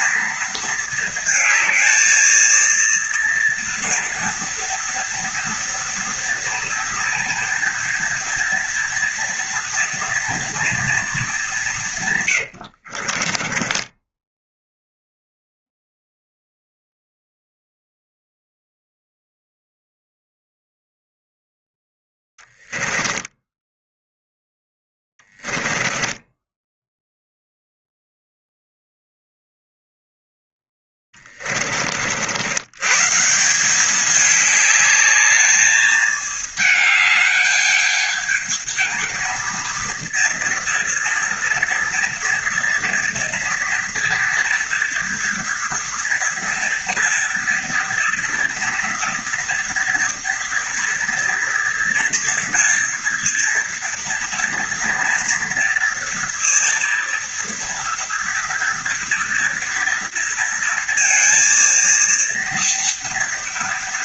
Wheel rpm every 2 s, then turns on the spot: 220, 230, 230, 230, 230, 220, 70, 0, 0, 0, 0, 10, 10, 0, 0, 20, 140, 210, 210, 220, 240, 240, 240, 230, 230, 230, 230, 230, 230, 230, 230, 230.
12-14 22-26 30-32